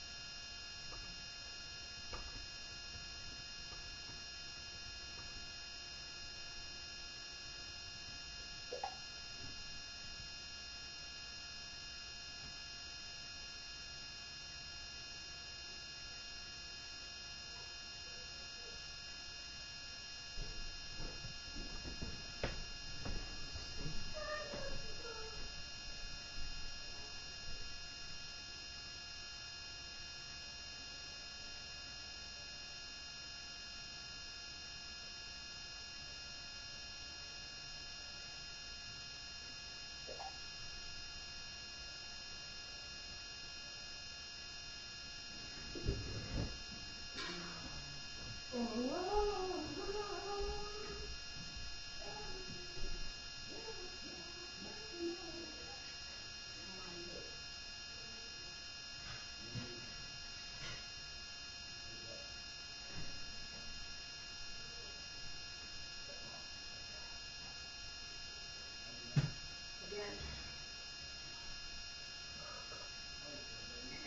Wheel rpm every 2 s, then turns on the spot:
0, 0, 0, 0, 0, 0, 0, 0, 0, 0, 0, 0, 0, 0, 0, 0, 0, 0, 0, 0, 0, 0, 0, 0, 0, 0, 0, 0, 0, 0, 0, 0, 0, 0, 0, 0, 0.
none